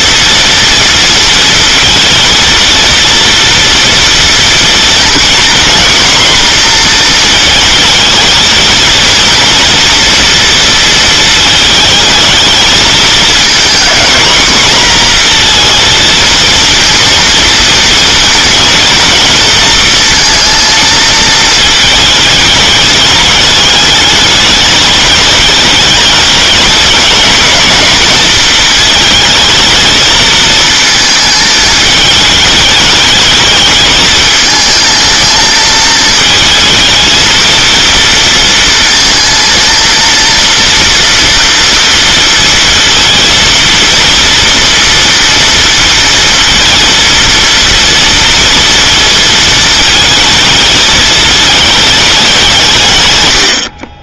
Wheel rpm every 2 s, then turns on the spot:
230, 230, 230, 230, 230, 230, 220, 240, 230, 230, 230, 210, 210, 210, 220, 220, 210, 220, 220, 230, 240, 230, 230, 230, 230, 220, 160.
none